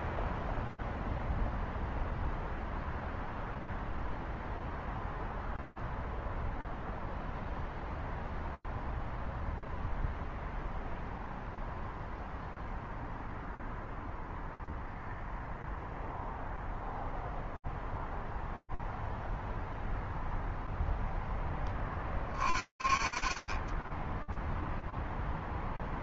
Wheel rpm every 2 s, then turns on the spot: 0, 0, 0, 0, 0, 0, 0, 0, 0, 0, 0, 20, 0.
none